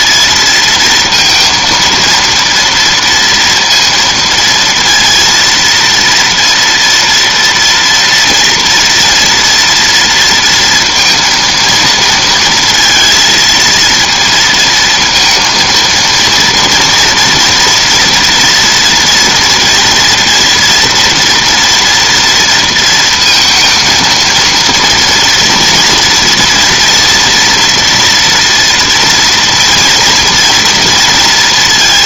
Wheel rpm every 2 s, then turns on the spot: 230, 230, 230, 230, 230, 230, 230, 230, 240, 230, 240, 230, 230, 230, 230, 230.
none